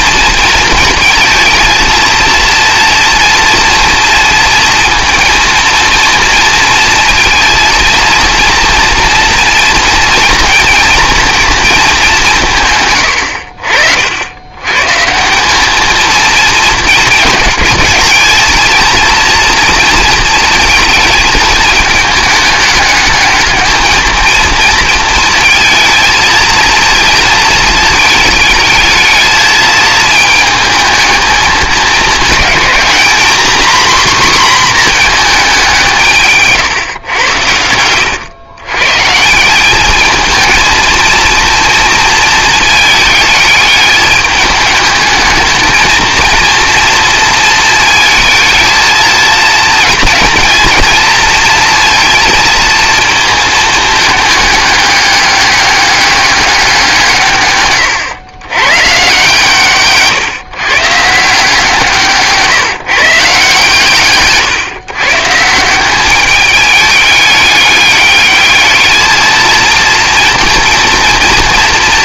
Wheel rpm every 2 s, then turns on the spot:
230, 230, 230, 230, 230, 230, 120, 120, 230, 220, 220, 220, 230, 230, 220, 220, 220, 240, 140, 130, 230, 220, 210, 230, 220, 230, 230, 200, 180, 130, 130, 150, 150, 210, 220, 230.
none